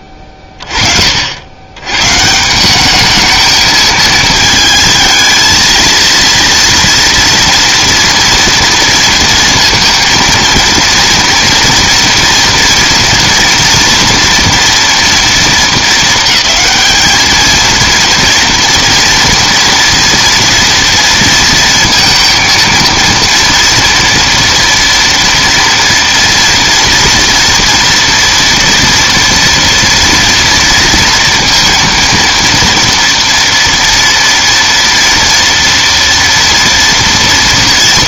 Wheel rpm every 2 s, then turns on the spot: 30, 200, 220, 240, 230, 230, 230, 230, 220, 230, 230, 230, 230, 230, 230, 230, 230, 230, 230.
none